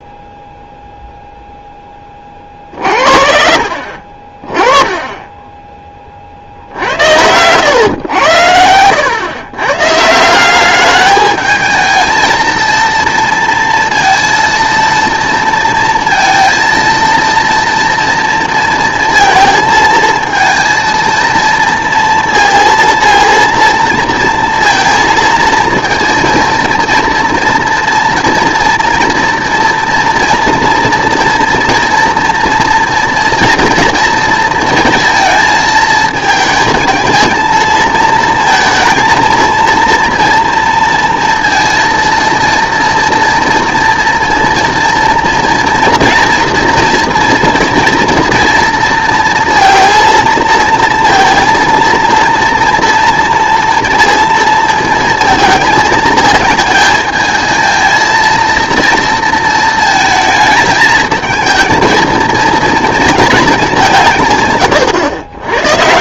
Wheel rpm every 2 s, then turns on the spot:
0, 40, 20, 70, 100, 200, 230, 230, 230, 230, 230, 230, 230, 230, 240, 230, 230, 230, 220, 230, 230, 230, 240, 230, 230, 230, 230, 220, 220, 230, 220, 230, 120.
4-6